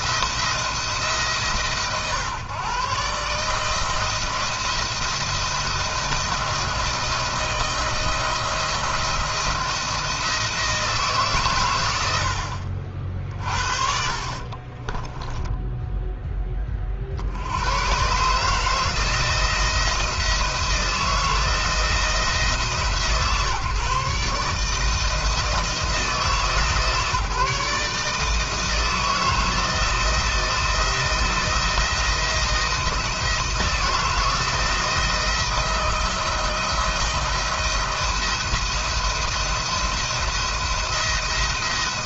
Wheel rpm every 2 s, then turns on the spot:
160, 130, 160, 160, 160, 170, 60, 40, 20, 140, 160, 160, 150, 160, 160, 160, 170, 170, 170, 170, 170.
14-16